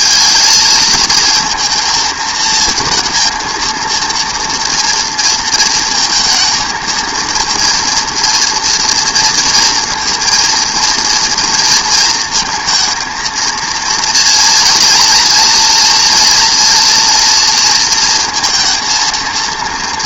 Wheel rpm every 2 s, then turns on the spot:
220, 230, 230, 220, 230, 230, 230, 230, 230, 230.
none